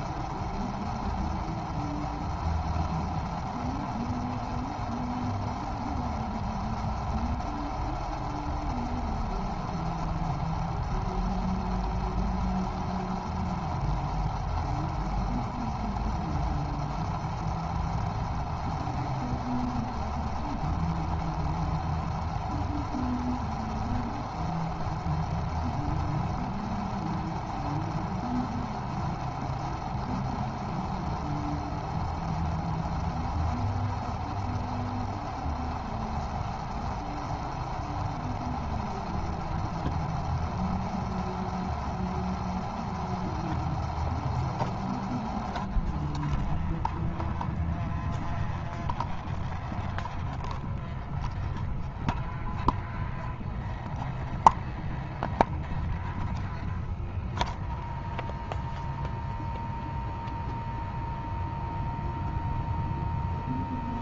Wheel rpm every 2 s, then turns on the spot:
0, 0, 0, 0, 0, 0, 0, 0, 0, 0, 0, 0, 0, 0, 0, 0, 0, 0, 0, 0, 0, 0, 0, 0, 0, 0, 0, 0, 0, 0, 0, 0.
none